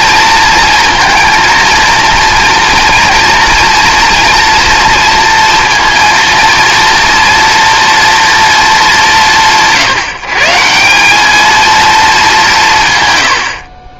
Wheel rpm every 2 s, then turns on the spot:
230, 230, 230, 230, 220, 170, 180.
none